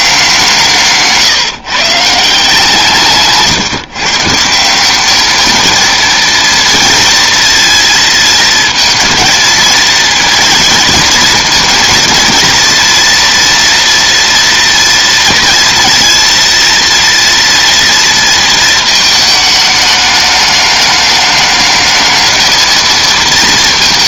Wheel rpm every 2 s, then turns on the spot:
170, 170, 170, 230, 230, 230, 240, 240, 230, 230, 210, 220.
none